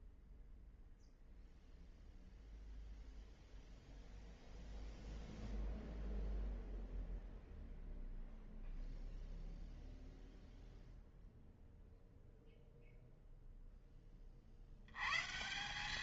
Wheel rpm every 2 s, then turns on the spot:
0, 0, 0, 0, 0, 0, 0, 110.
none